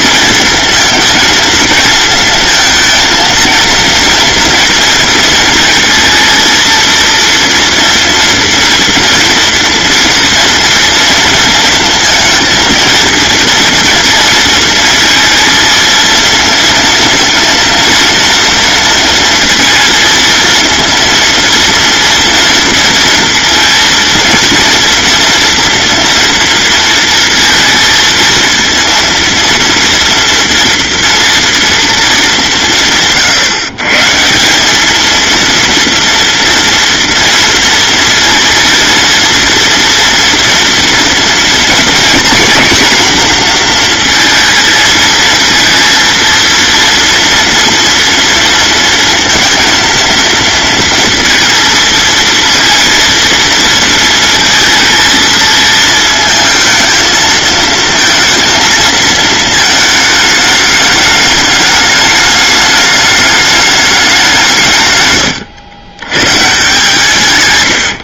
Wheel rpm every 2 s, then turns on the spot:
220, 220, 230, 230, 240, 230, 230, 230, 230, 230, 230, 230, 230, 230, 230, 230, 120, 200, 240, 230, 230, 250, 230, 230, 230, 230, 230, 230, 220, 220, 210, 210, 160, 130.
none